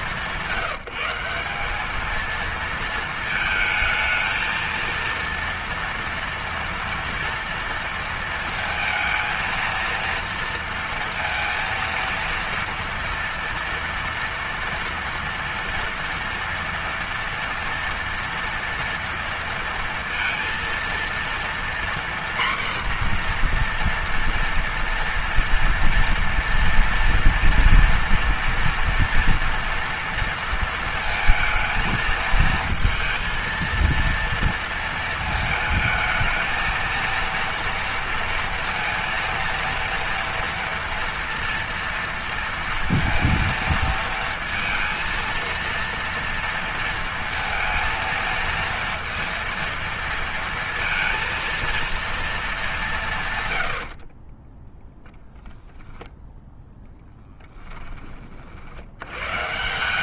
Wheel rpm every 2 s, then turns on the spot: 170, 220, 230, 240, 220, 230, 230, 230, 230, 230, 230, 250, 230, 230, 240, 230, 230, 230, 220, 230, 230, 230, 230, 230, 230, 230, 210, 20, 10, 50.
54-56